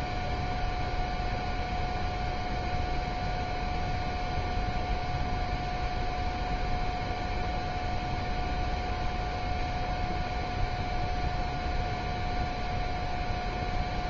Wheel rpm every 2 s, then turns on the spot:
0, 0, 0, 0, 0, 0, 0.
none